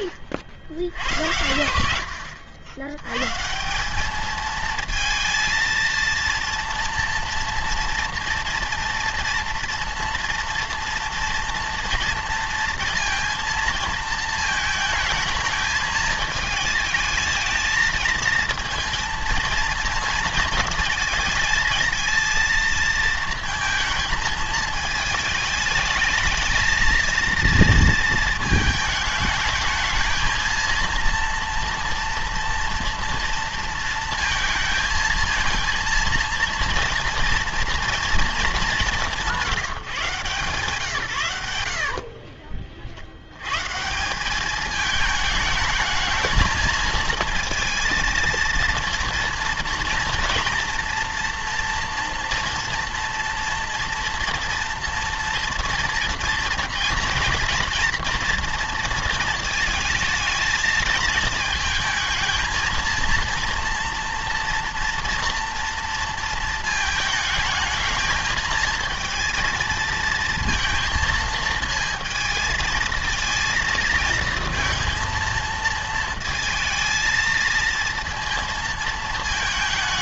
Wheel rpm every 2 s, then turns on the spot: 70, 90, 220, 230, 230, 230, 230, 220, 220, 230, 230, 230, 220, 220, 220, 220, 230, 230, 230, 210, 140, 40, 210, 220, 230, 230, 230, 240, 240, 230, 220, 230, 230, 220, 220, 230, 220, 230, 220, 230.
none